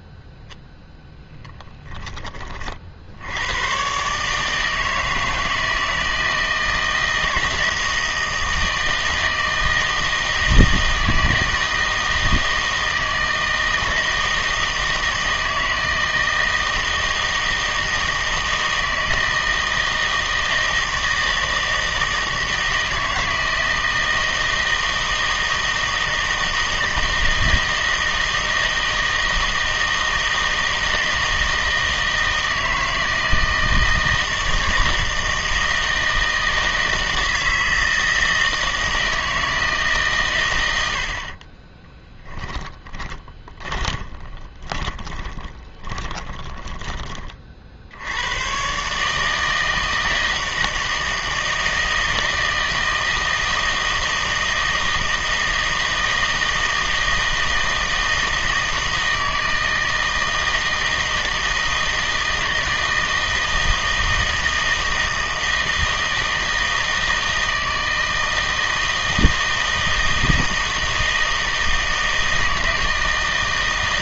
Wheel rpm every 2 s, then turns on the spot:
10, 50, 160, 160, 160, 160, 160, 160, 160, 160, 160, 160, 160, 160, 160, 160, 160, 160, 160, 160, 90, 20, 20, 20, 130, 160, 160, 160, 160, 160, 160, 160, 160, 160, 160, 160, 160.
42-48